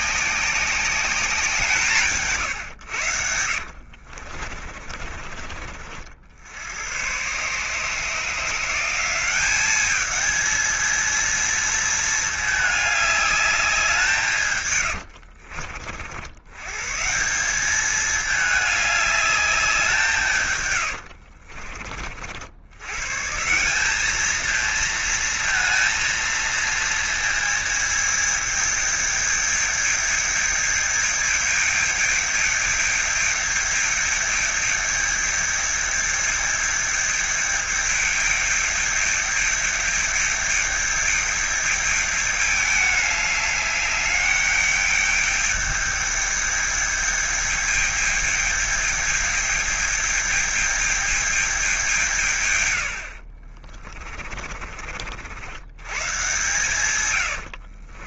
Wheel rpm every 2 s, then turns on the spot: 190, 100, 50, 110, 180, 220, 210, 110, 140, 210, 100, 100, 220, 220, 210, 210, 210, 210, 210, 210, 210, 210, 210, 210, 210, 210, 90, 40, 120.
4-6 14-16 20-22